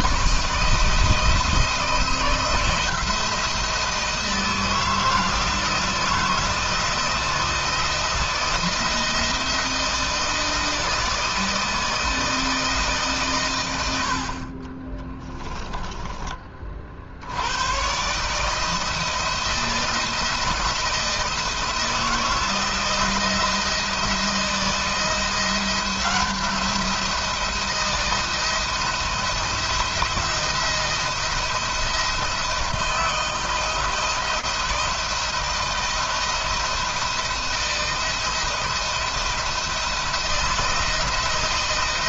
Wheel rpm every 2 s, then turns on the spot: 160, 170, 160, 160, 160, 160, 140, 20, 60, 160, 160, 170, 170, 170, 160, 170, 170, 170, 170, 170, 170.
14-16